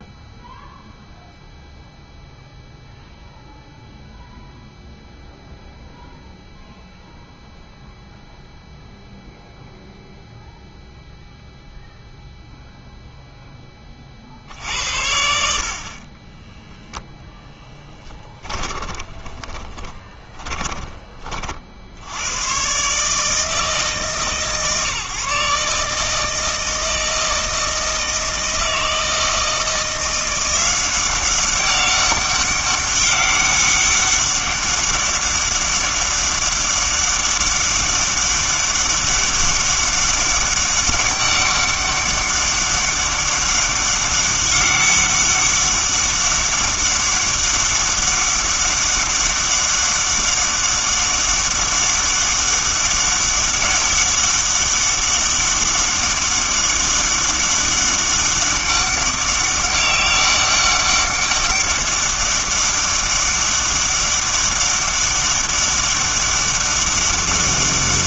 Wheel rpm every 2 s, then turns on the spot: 0, 0, 0, 0, 0, 0, 0, 70, 0, 20, 20, 130, 140, 160, 160, 180, 200, 200, 200, 200, 200, 200, 200, 200, 200, 200, 200, 200, 200, 200, 200, 200, 200, 200.
18-22